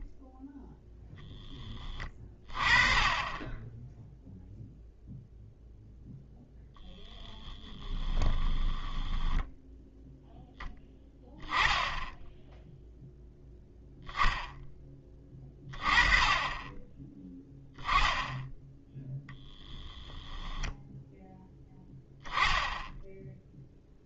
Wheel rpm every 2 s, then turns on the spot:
0, 20, 0, 10, 10, 10, 10, 20, 10, 10, 10, 10.
6-10